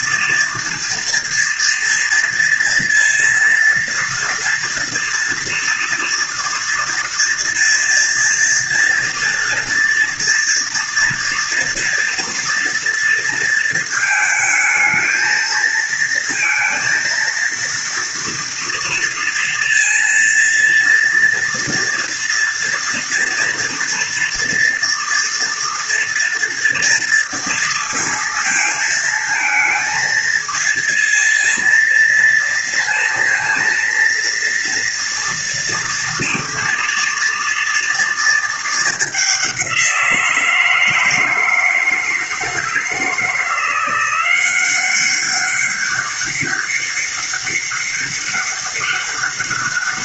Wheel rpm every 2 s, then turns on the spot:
230, 230, 230, 230, 230, 230, 230, 220, 230, 230, 230, 240, 230, 230, 220, 230, 230, 230, 230, 220, 170, 160, 180, 200, 200.
none